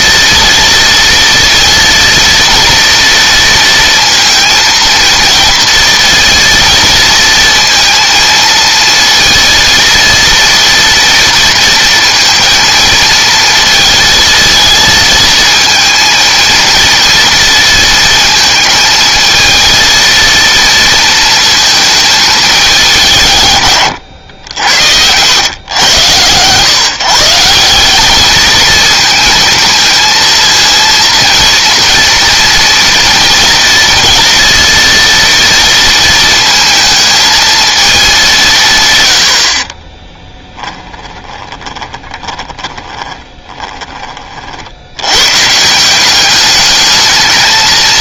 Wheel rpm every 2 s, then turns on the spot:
230, 230, 230, 230, 230, 230, 230, 220, 230, 220, 230, 200, 90, 140, 220, 230, 230, 230, 220, 140, 10, 20, 80, 210.
40-44